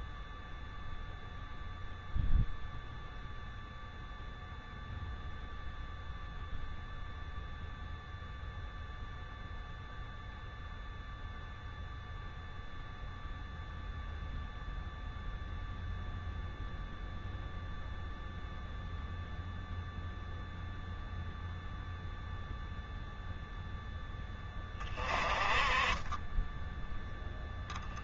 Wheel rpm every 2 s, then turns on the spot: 0, 0, 0, 0, 0, 0, 0, 0, 0, 0, 0, 0, 30, 0.
none